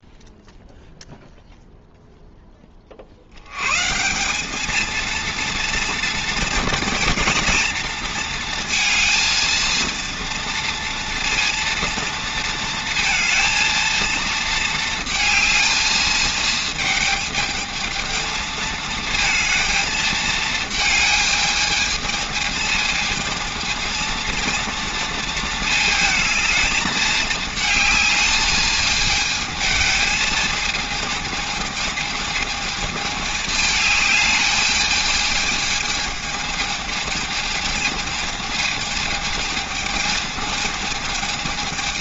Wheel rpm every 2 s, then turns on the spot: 0, 20, 210, 230, 230, 230, 230, 230, 220, 220, 220, 220, 230, 220, 220, 220, 220, 210, 220, 220, 220.
none